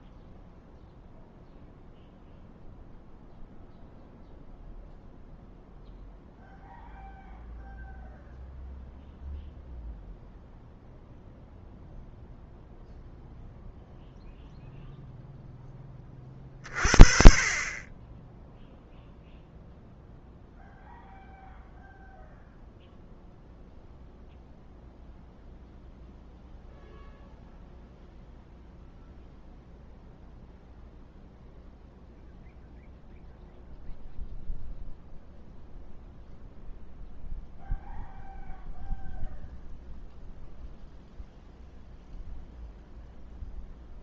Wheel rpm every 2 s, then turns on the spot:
0, 0, 0, 0, 0, 0, 0, 0, 40, 10, 0, 0, 0, 0, 0, 0, 0, 0, 0, 0, 0, 0.
none